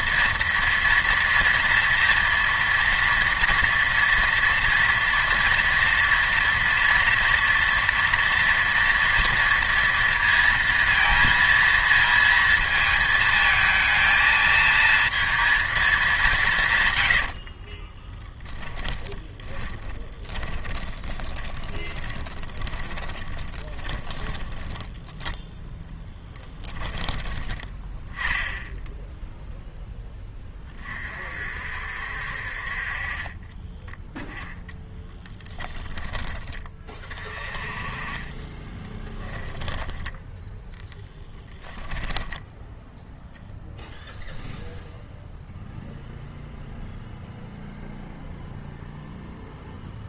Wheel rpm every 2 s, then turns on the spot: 230, 240, 230, 230, 230, 230, 220, 230, 130, 30, 20, 20, 20, 20, 0, 40, 40, 10, 30, 10, 10, 0, 0, 0, 0.
16-28 34-36 38-42